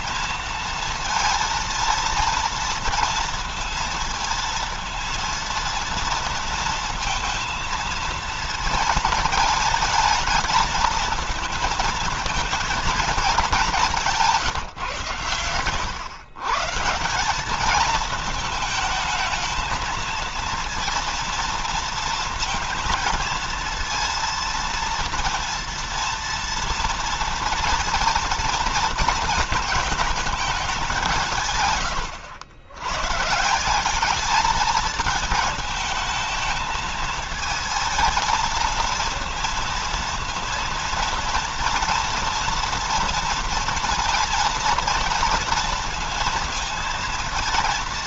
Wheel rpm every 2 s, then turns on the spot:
230, 230, 230, 230, 220, 220, 230, 140, 160, 220, 230, 230, 230, 230, 230, 180, 120, 220, 220, 230, 230, 230, 230, 230.
none